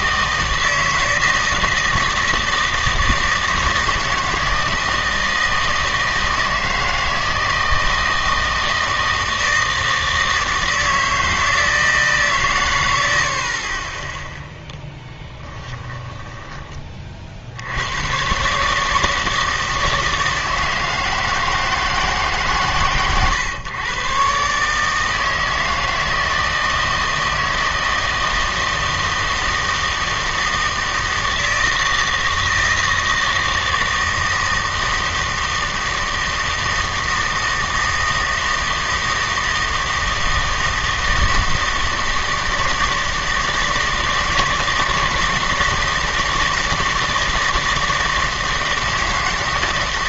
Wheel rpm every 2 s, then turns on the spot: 160, 160, 160, 160, 160, 160, 60, 10, 50, 160, 160, 130, 160, 160, 160, 160, 160, 160, 160, 160, 160, 160, 160, 160, 160.
14-16